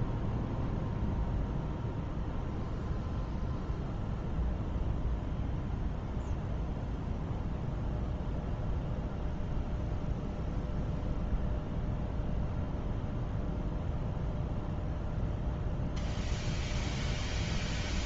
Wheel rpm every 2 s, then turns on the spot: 0, 0, 0, 0, 0, 0, 0, 0, 0.
none